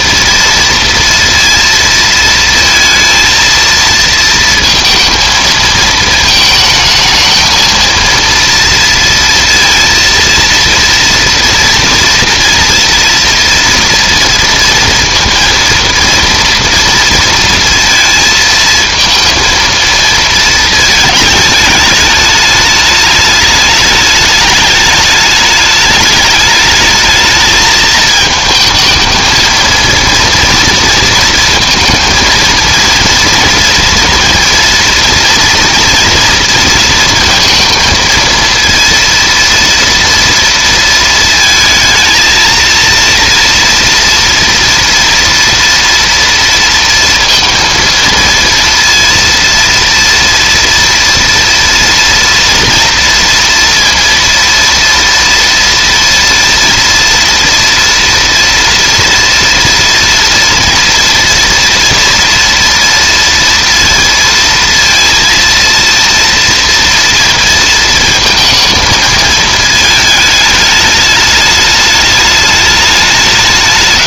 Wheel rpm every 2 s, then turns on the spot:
230, 230, 230, 220, 230, 230, 230, 230, 230, 230, 220, 210, 210, 220, 220, 230, 230, 240, 230, 230, 230, 230, 230, 230, 230, 230, 230, 230, 230, 230, 230, 230, 230, 230, 220, 210, 210.
none